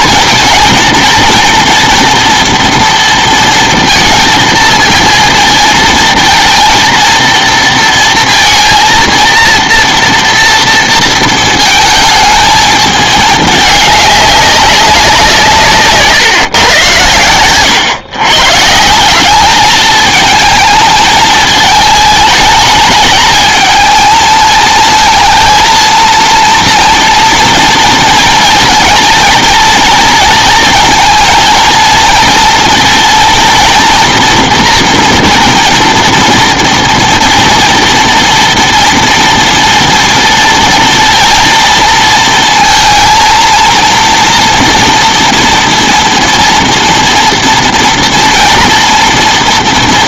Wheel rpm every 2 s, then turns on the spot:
230, 230, 230, 230, 230, 230, 220, 200, 120, 150, 220, 220, 230, 230, 230, 230, 230, 230, 230, 230, 230, 230, 230, 230, 230.
none